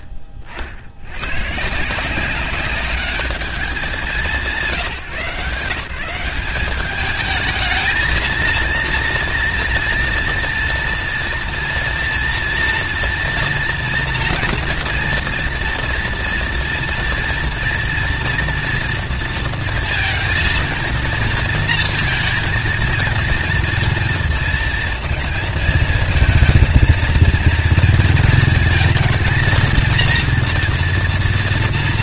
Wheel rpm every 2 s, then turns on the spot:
40, 190, 150, 200, 230, 230, 230, 240, 230, 230, 230, 230, 230, 230, 230, 230.
none